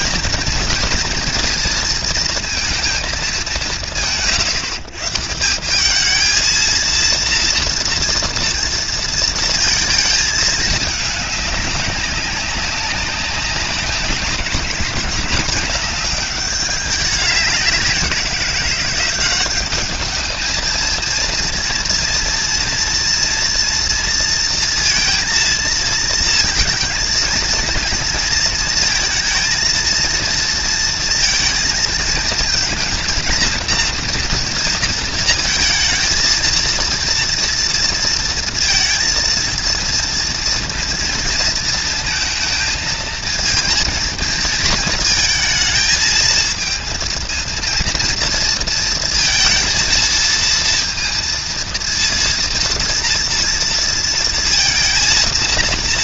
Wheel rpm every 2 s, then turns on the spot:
230, 230, 150, 230, 230, 220, 200, 200, 200, 180, 220, 230, 230, 230, 230, 230, 230, 240, 230, 230, 230, 230, 230, 220, 230, 230, 230, 230.
none